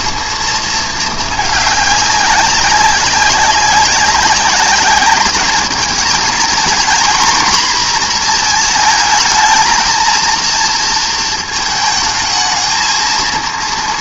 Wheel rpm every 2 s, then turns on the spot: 230, 200, 200, 230, 230, 230, 220.
none